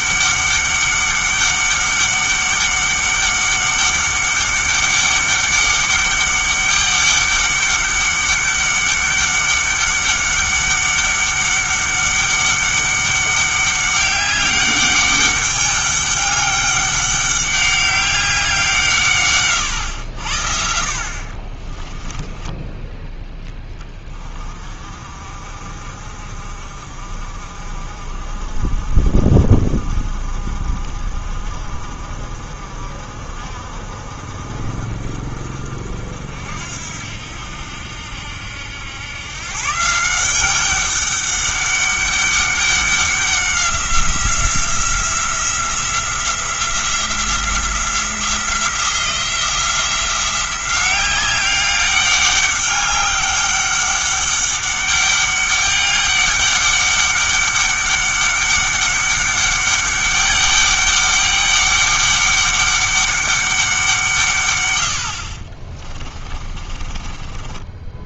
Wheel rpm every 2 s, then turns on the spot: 200, 200, 200, 200, 200, 200, 200, 200, 200, 160, 60, 10, 40, 50, 50, 50, 50, 50, 70, 90, 190, 190, 180, 180, 170, 180, 200, 200, 200, 200, 200, 200, 110, 30.
22-24 66-68